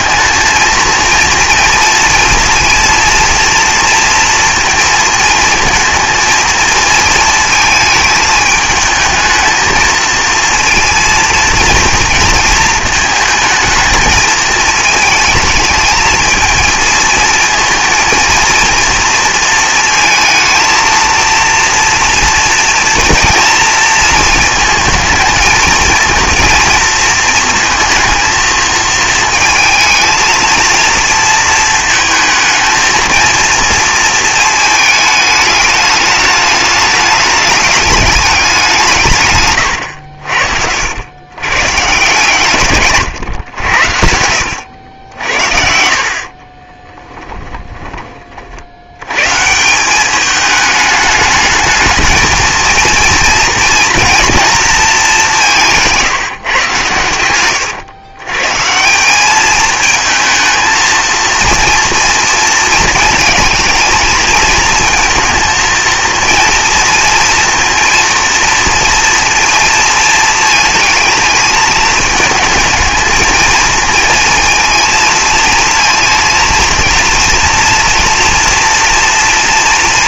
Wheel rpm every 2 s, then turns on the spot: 230, 230, 230, 230, 220, 230, 220, 220, 220, 230, 230, 230, 230, 230, 230, 230, 230, 220, 210, 170, 80, 130, 80, 30, 50, 210, 220, 230, 130, 150, 220, 230, 230, 230, 230, 220, 220, 230, 230, 240.
42-48